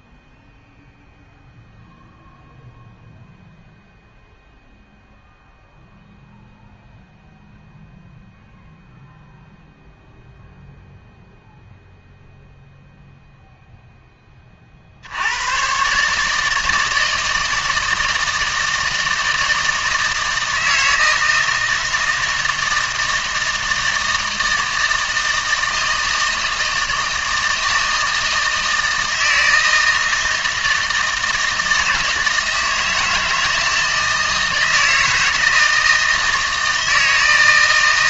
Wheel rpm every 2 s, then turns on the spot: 0, 0, 0, 0, 0, 0, 0, 50, 160, 160, 160, 160, 160, 160, 160, 160, 160, 160, 160.
none